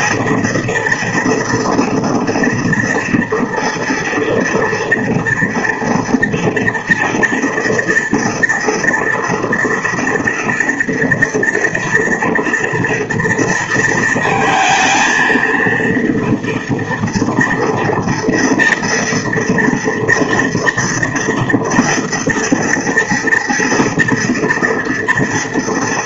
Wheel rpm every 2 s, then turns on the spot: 230, 230, 230, 240, 230, 230, 230, 220, 240, 230, 230, 230, 230.
none